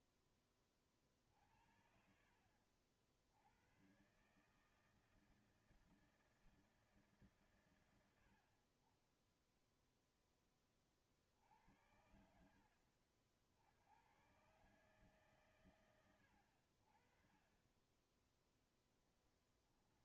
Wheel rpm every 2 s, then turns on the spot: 10, 50, 130, 160, 90, 20, 60, 100, 100, 10.
none